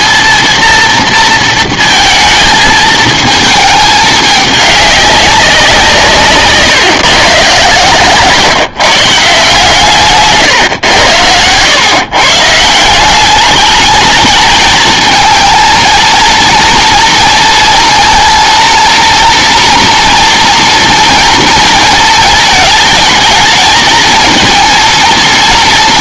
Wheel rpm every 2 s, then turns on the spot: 230, 220, 200, 140, 140, 130, 160, 220, 240, 230, 230, 220, 230.
none